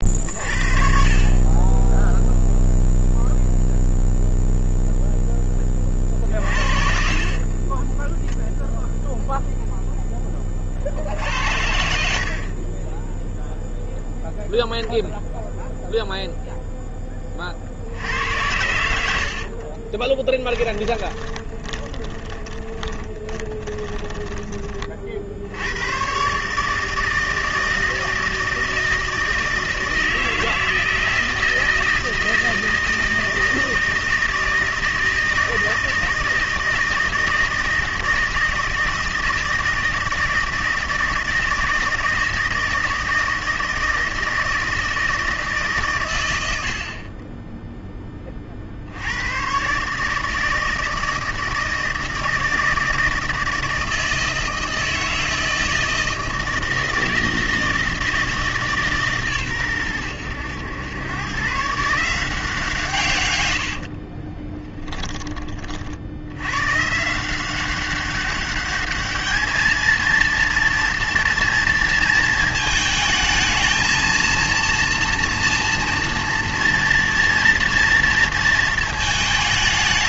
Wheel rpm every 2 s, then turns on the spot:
40, 0, 0, 40, 0, 50, 20, 0, 10, 90, 30, 20, 30, 160, 160, 160, 160, 160, 160, 160, 160, 160, 160, 70, 70, 160, 160, 160, 160, 150, 110, 150, 10, 130, 210, 230, 220, 230, 230, 230.
6-8 18-24 64-66